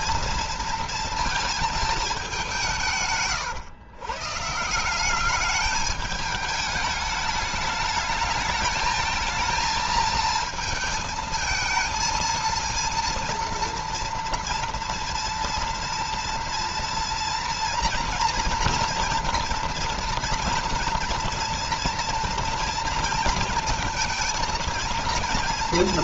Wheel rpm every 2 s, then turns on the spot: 230, 170, 170, 210, 220, 220, 230, 230, 230, 230, 230, 230, 230.
none